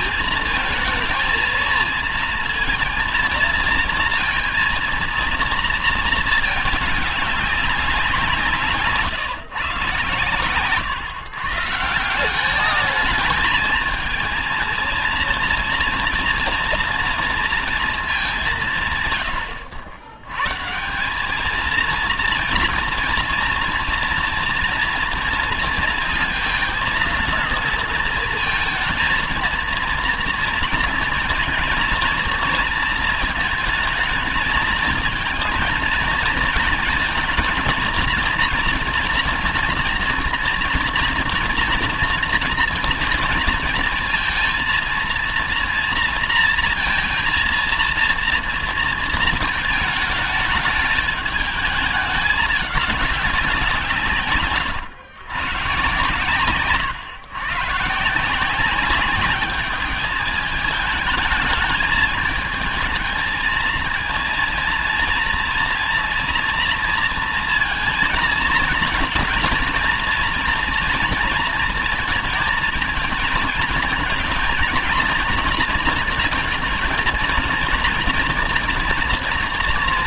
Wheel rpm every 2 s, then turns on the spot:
220, 230, 230, 210, 160, 130, 190, 220, 230, 190, 140, 230, 230, 230, 230, 230, 230, 230, 230, 240, 230, 230, 230, 230, 230, 220, 210, 130, 140, 180, 210, 220, 230, 230, 230, 230, 230, 230, 230, 230.
54-56